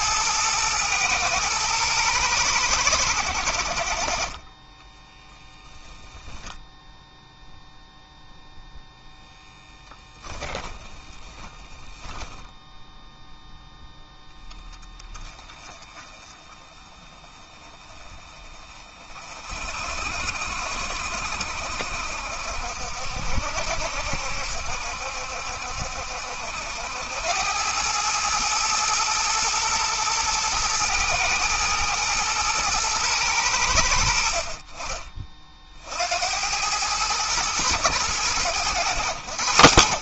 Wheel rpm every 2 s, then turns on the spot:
110, 90, 10, 0, 0, 10, 0, 20, 20, 30, 70, 60, 70, 90, 110, 110, 110, 30, 110, 90.
4-6 10-12